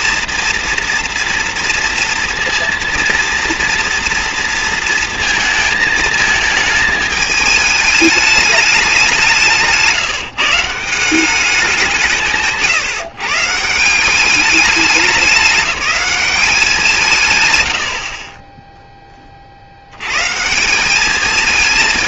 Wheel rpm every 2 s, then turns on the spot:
240, 230, 230, 220, 200, 150, 150, 200, 180, 10, 180.
none